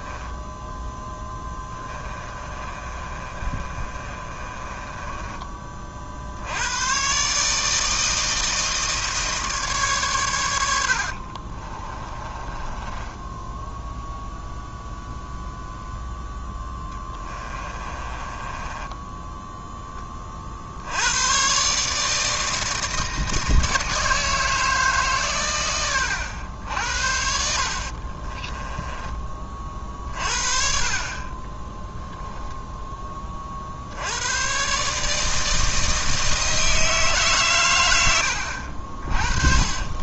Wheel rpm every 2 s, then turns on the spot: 10, 30, 20, 100, 160, 80, 20, 0, 10, 20, 70, 160, 160, 80, 20, 40, 10, 130, 160, 60.
0-6 12-14 16-20 28-30 38-40